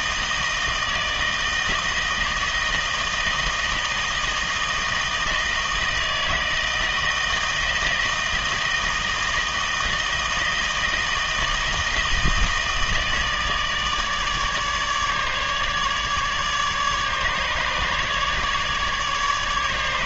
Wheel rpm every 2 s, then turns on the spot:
160, 160, 160, 160, 160, 160, 160, 150, 150, 150.
none